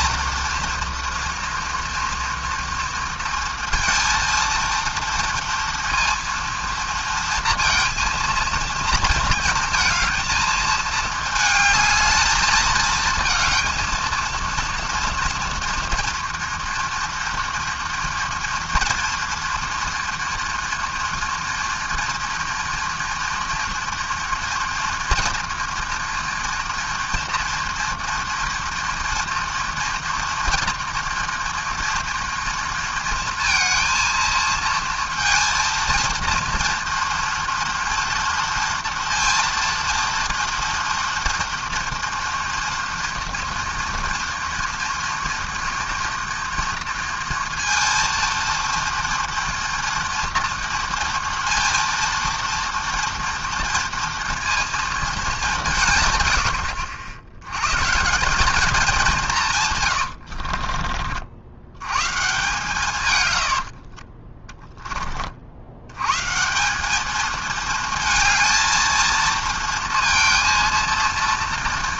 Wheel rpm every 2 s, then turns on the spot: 240, 230, 230, 230, 230, 220, 220, 230, 240, 240, 230, 230, 230, 230, 230, 240, 230, 230, 230, 230, 230, 230, 230, 230, 230, 230, 230, 230, 80, 210, 60, 150, 10, 180, 230, 230.
60-62